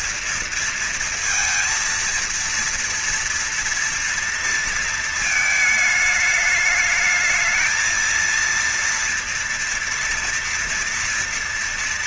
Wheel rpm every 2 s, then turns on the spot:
230, 230, 230, 220, 230, 230.
none